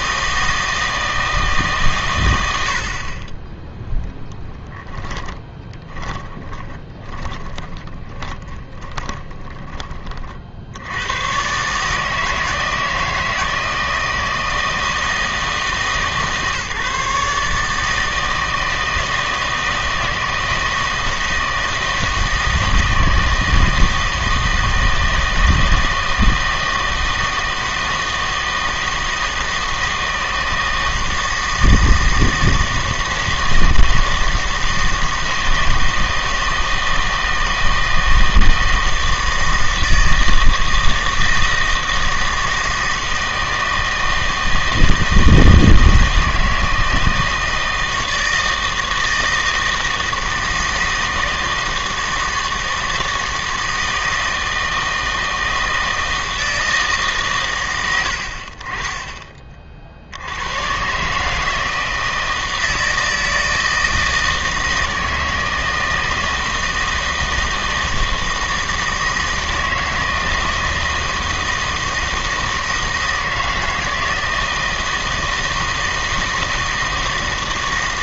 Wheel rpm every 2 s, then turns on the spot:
160, 70, 10, 10, 20, 70, 160, 160, 150, 160, 160, 160, 160, 160, 160, 160, 160, 160, 160, 160, 160, 160, 160, 160, 160, 160, 160, 160, 160, 30, 120, 160, 160, 160, 160, 160, 160, 160, 160.
4-6 8-10